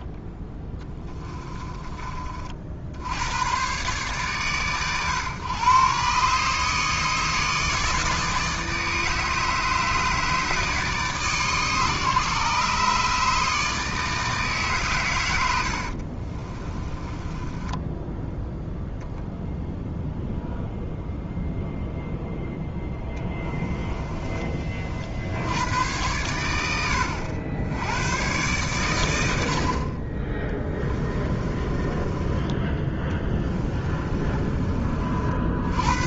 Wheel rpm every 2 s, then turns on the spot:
10, 70, 100, 150, 160, 150, 140, 140, 20, 0, 0, 10, 40, 90, 90, 30, 10, 30.
16-18 22-24 30-34